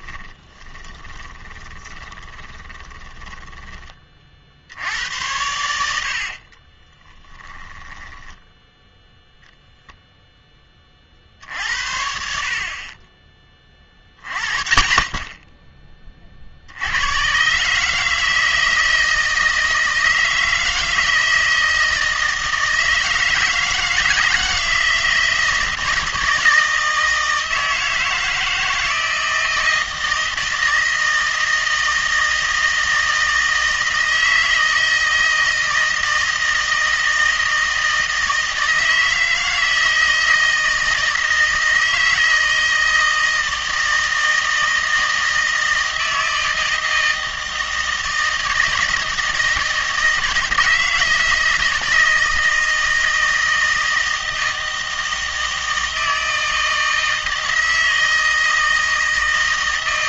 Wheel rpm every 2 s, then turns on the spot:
10, 20, 60, 30, 10, 10, 50, 30, 60, 160, 160, 160, 160, 160, 160, 160, 160, 160, 160, 160, 160, 160, 160, 160, 160, 160, 160, 160, 160, 160.
0-4 6-10